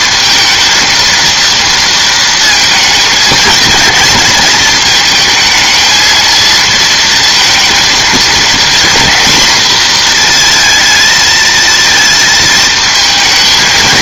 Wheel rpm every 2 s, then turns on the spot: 220, 230, 220, 230, 230, 220, 220.
none